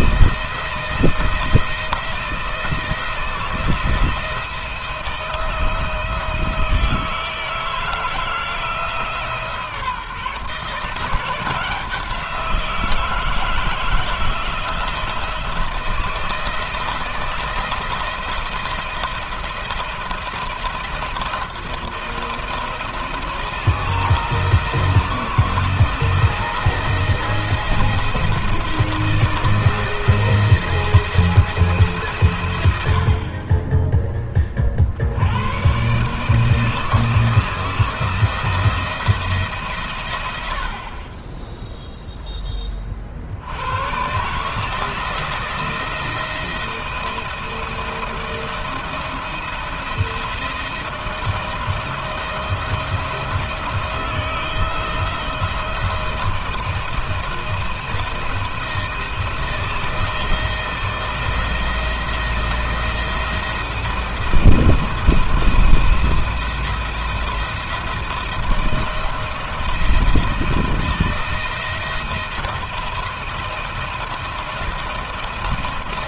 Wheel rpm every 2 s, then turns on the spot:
170, 170, 170, 160, 160, 160, 170, 160, 160, 170, 170, 170, 160, 170, 170, 170, 100, 40, 160, 170, 90, 10, 140, 170, 160, 170, 160, 160, 170, 170, 170, 170, 170, 170, 170, 170, 170, 170.
none